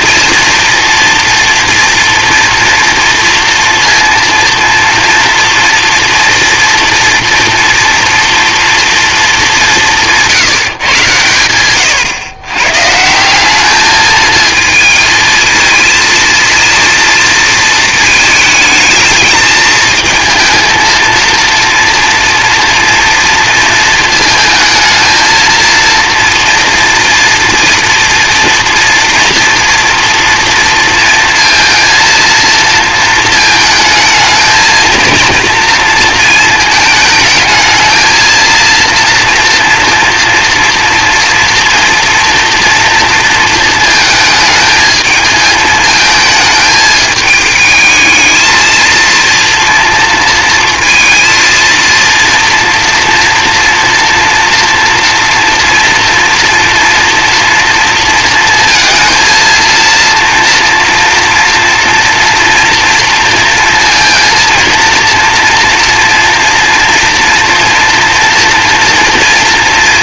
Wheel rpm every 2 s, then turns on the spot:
230, 230, 230, 230, 240, 150, 120, 220, 230, 220, 230, 230, 220, 240, 230, 230, 230, 220, 220, 230, 230, 230, 220, 220, 230, 230, 230, 230, 230, 230, 230, 230, 230, 230, 230.
none